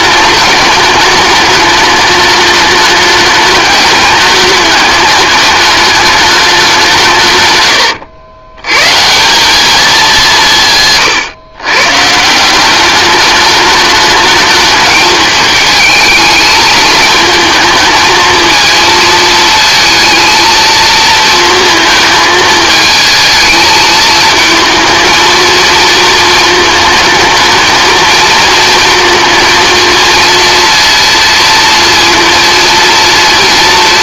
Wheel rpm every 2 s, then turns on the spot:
210, 210, 210, 190, 100, 160, 180, 210, 220, 230, 230, 220, 220, 220, 220, 230, 230.
none